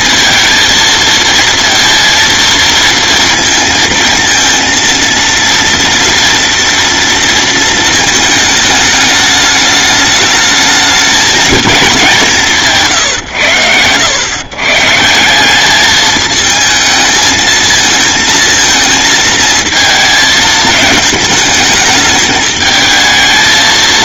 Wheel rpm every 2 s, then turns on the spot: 220, 230, 230, 230, 210, 210, 160, 150, 220, 220, 220, 220.
none